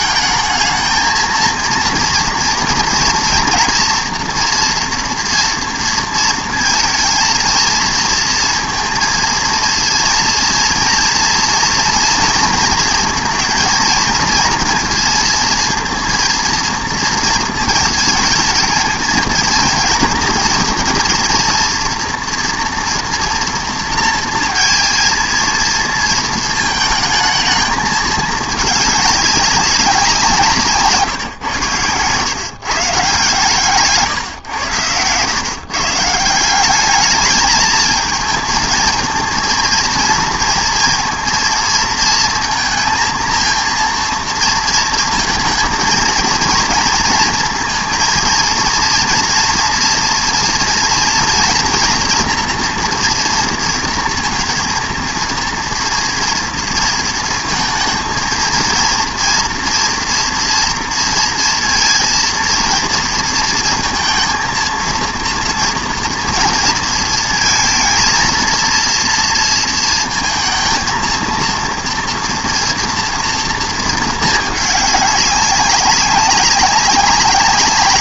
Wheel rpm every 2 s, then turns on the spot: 220, 240, 230, 230, 230, 230, 230, 230, 230, 220, 230, 230, 230, 220, 210, 170, 140, 130, 180, 220, 230, 230, 230, 230, 230, 230, 230, 230, 230, 230, 230, 230, 230, 230, 230, 230, 230, 210, 200.
none